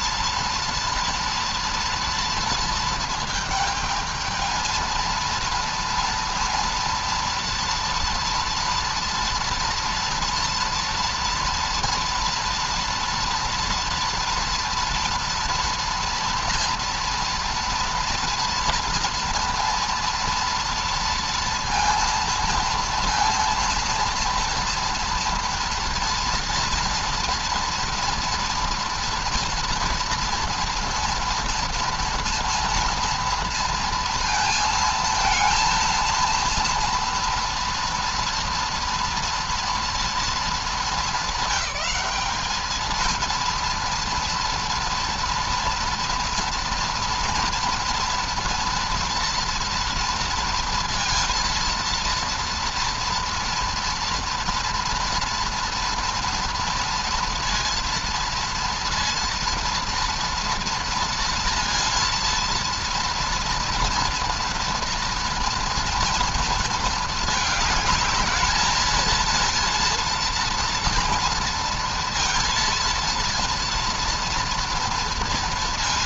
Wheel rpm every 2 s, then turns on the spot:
230, 230, 220, 230, 230, 230, 230, 240, 230, 230, 230, 230, 230, 240, 240, 230, 230, 230, 230, 230, 220, 220, 240, 240, 240, 230, 230, 240, 230, 230, 240, 230, 230, 230, 220, 230, 230, 230.
none